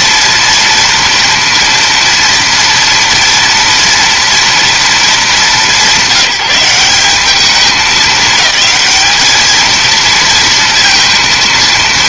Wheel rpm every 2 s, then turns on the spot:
230, 230, 220, 190, 210, 230.
none